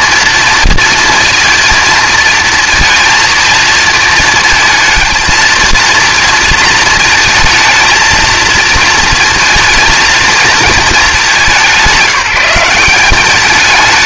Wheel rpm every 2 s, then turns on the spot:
230, 230, 230, 230, 220, 220, 180.
none